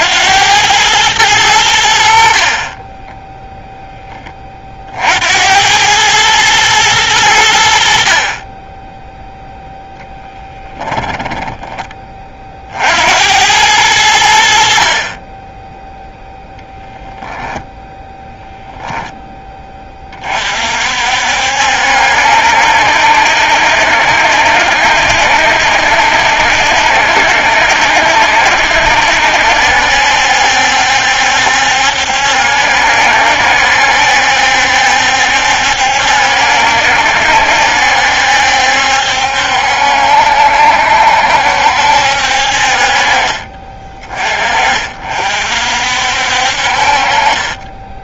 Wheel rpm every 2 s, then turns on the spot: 100, 30, 50, 110, 20, 20, 60, 50, 0, 10, 50, 70, 70, 70, 70, 70, 70, 70, 60, 70, 70, 50, 40, 50.
2-4 10-12